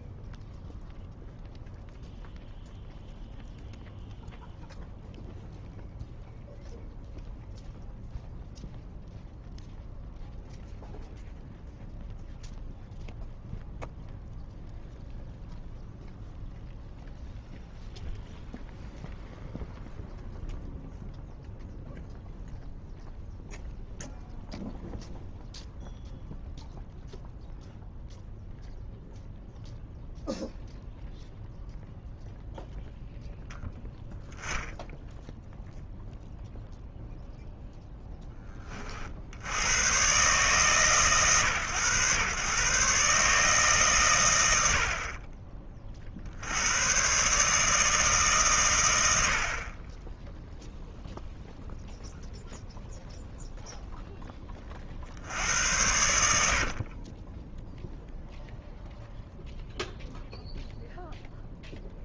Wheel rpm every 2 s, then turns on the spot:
0, 0, 0, 0, 0, 0, 0, 0, 0, 0, 0, 0, 0, 0, 0, 0, 0, 0, 0, 40, 140, 140, 70, 100, 130, 0, 0, 30, 50, 0, 0.
56-58